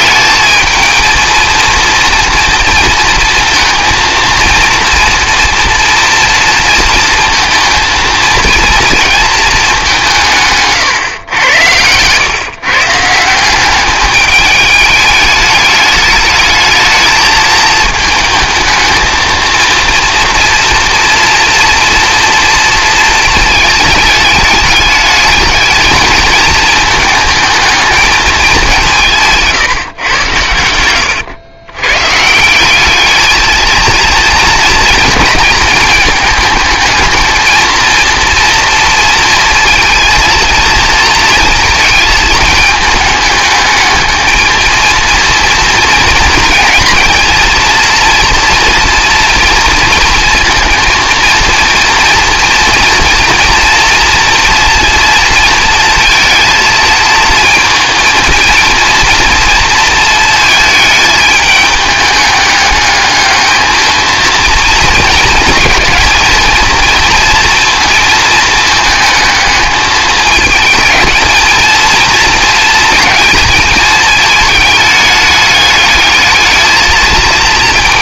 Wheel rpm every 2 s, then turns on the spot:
220, 230, 230, 230, 230, 130, 150, 210, 220, 220, 240, 220, 210, 220, 180, 100, 200, 220, 220, 230, 230, 210, 230, 230, 240, 230, 230, 230, 220, 230, 220, 210, 220, 230, 220, 220, 230, 210, 220.
none